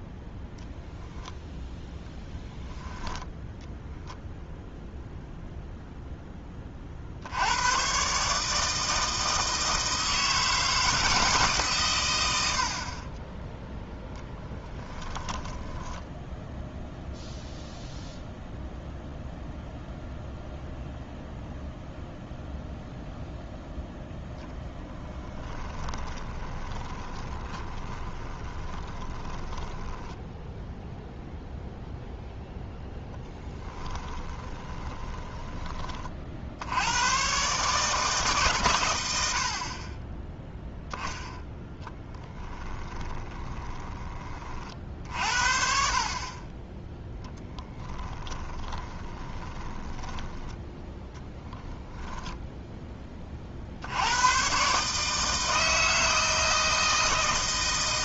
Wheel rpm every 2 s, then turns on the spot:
0, 0, 0, 30, 160, 160, 60, 10, 0, 0, 0, 0, 0, 20, 20, 0, 0, 20, 80, 120, 0, 10, 50, 20, 20, 10, 10, 130, 160.
14-16 26-30 34-36 42-44 48-50